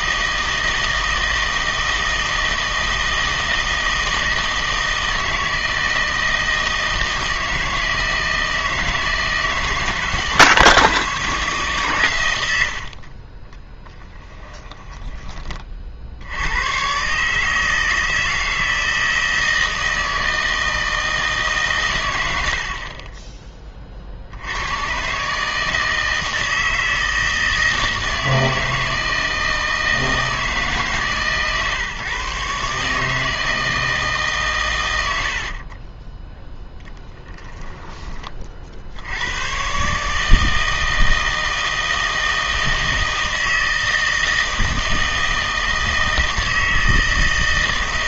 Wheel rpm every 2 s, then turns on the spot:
160, 160, 160, 160, 160, 160, 80, 10, 100, 160, 160, 60, 90, 160, 160, 160, 140, 130, 10, 50, 160, 160, 160, 160.
14-16 36-38